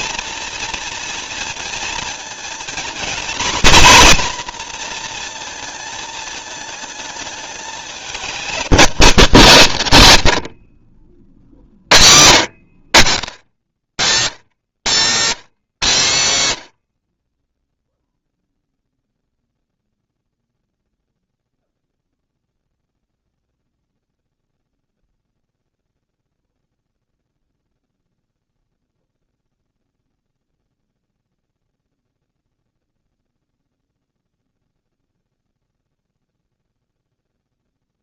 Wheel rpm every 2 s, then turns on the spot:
230, 230, 240, 220, 220, 80, 90, 120, 110, 0, 0, 0, 0, 0, 0, 0, 0, 0, 0.
12-14